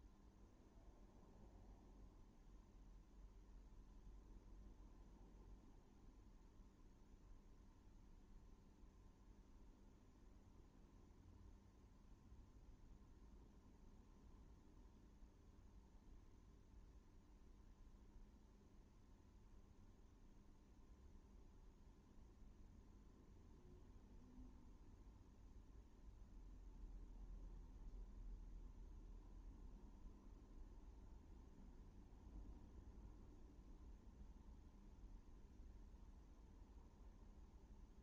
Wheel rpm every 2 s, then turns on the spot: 0, 0, 0, 0, 0, 0, 0, 0, 0, 0, 0, 0, 0, 0, 0, 0, 0, 0, 0.
none